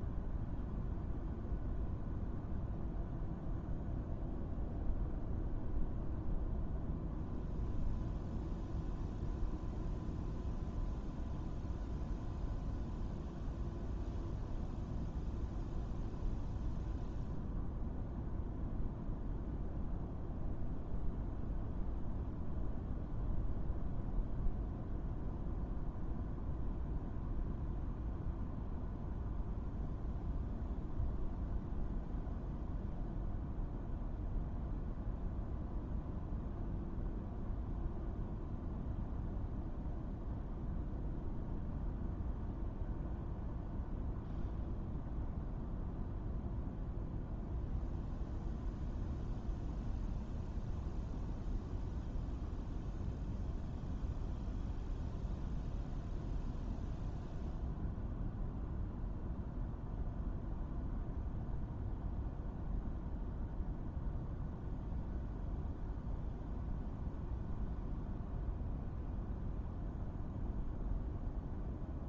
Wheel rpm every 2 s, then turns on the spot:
0, 0, 0, 0, 0, 0, 0, 0, 0, 0, 0, 0, 0, 0, 0, 0, 0, 0, 0, 0, 0, 0, 0, 0, 0, 0, 0, 0, 0, 0, 0, 0, 0, 0, 0, 0.
none